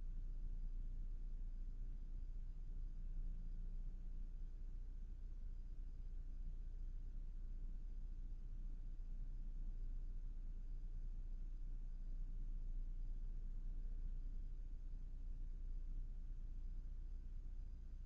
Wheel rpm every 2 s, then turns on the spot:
0, 0, 0, 0, 0, 0, 0, 0, 0.
none